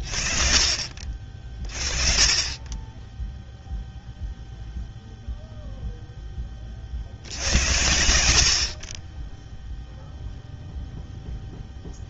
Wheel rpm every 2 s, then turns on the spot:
20, 0, 0, 70, 20, 0.
none